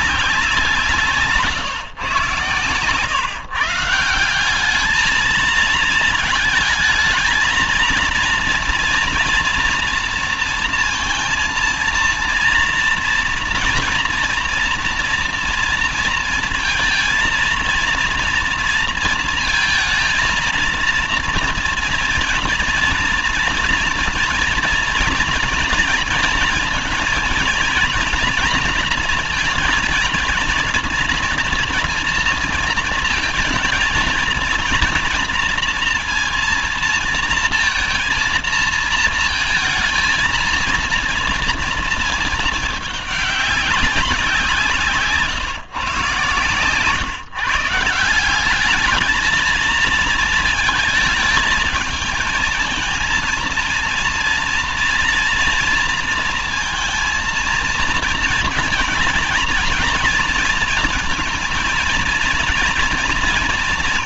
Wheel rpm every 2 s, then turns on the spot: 170, 130, 200, 220, 230, 230, 230, 230, 230, 230, 230, 230, 240, 230, 230, 220, 230, 230, 230, 230, 230, 210, 160, 130, 210, 220, 220, 240, 230, 230, 230, 230.
none